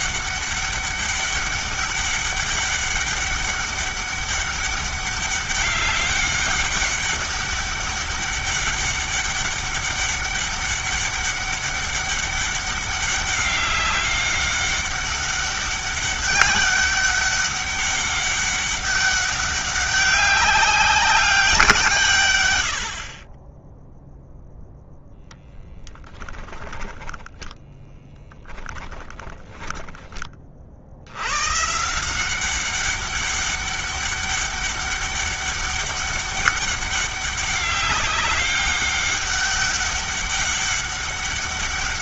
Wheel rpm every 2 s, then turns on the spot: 200, 200, 200, 200, 200, 200, 200, 200, 200, 200, 200, 80, 0, 10, 10, 40, 190, 200, 200, 200, 200.
26-30